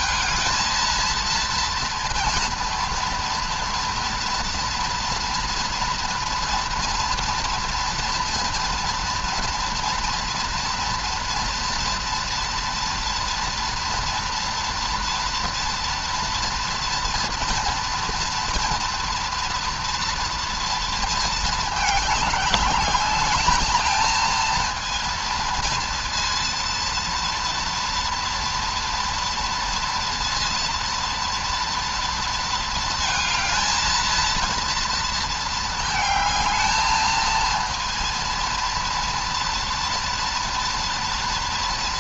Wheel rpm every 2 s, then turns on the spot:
220, 230, 230, 230, 240, 240, 230, 230, 230, 230, 230, 210, 230, 230, 230, 230, 230, 230, 220, 230, 230.
none